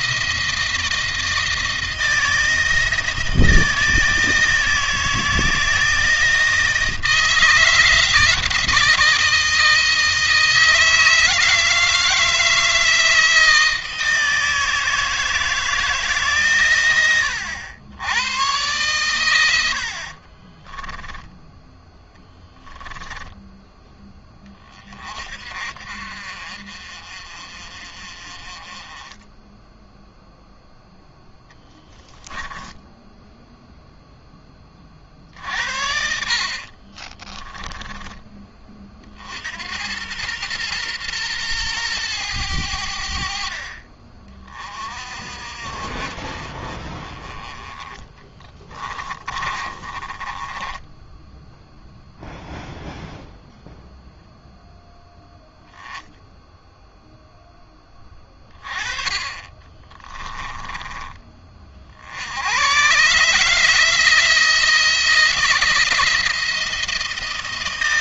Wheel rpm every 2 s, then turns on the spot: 160, 160, 160, 160, 170, 160, 160, 160, 120, 110, 20, 10, 30, 50, 30, 0, 10, 30, 50, 30, 110, 80, 40, 40, 20, 20, 0, 0, 0, 30, 10, 120, 170, 170.
20-22 32-34 36-38 48-52 58-60